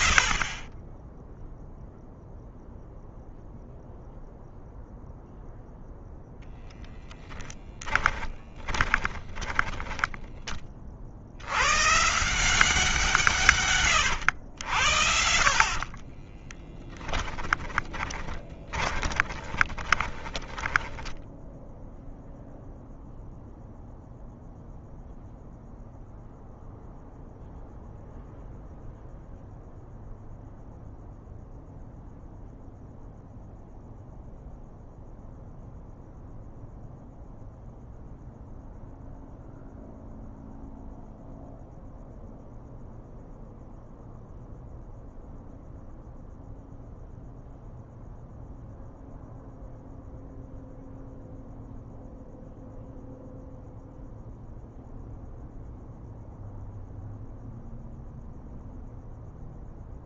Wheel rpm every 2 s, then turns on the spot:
40, 0, 0, 0, 20, 30, 180, 80, 10, 30, 10, 0, 0, 0, 0, 0, 0, 0, 0, 0, 0, 0, 0, 0, 0, 0, 0, 0, 0, 0.
8-10 16-22